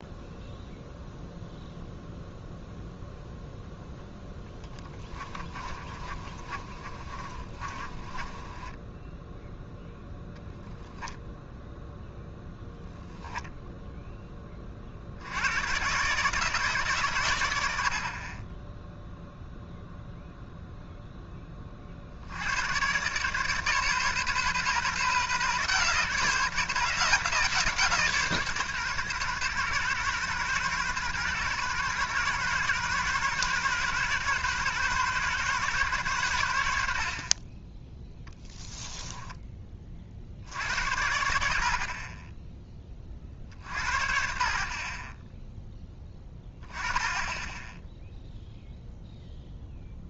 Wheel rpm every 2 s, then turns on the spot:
0, 0, 10, 30, 20, 0, 0, 30, 140, 10, 0, 100, 140, 160, 140, 130, 130, 130, 80, 10, 70, 20, 50, 10, 0.
4-10 38-40